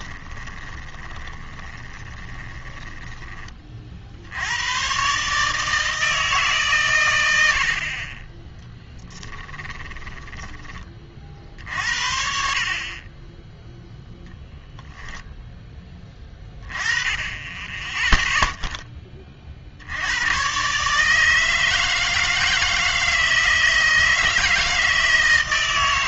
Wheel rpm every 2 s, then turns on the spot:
20, 20, 90, 150, 10, 20, 60, 0, 10, 0, 130, 160, 160.
0-4